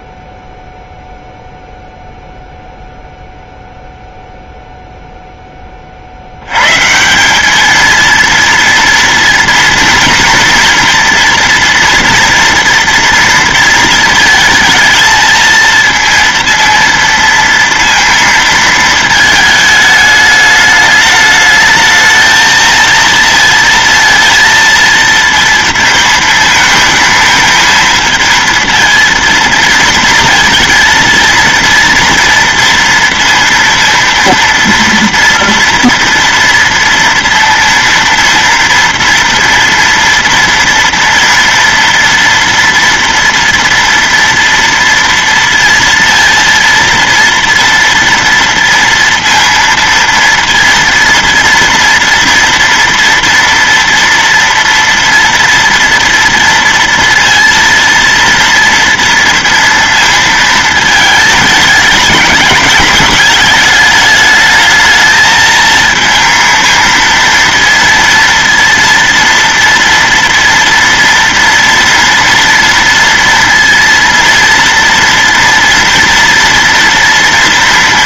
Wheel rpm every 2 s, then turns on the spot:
0, 0, 0, 80, 230, 230, 240, 230, 230, 230, 210, 220, 230, 220, 230, 230, 230, 230, 230, 230, 230, 230, 230, 230, 230, 230, 230, 230, 230, 230, 220, 220, 210, 220, 230, 230, 230, 230, 230.
none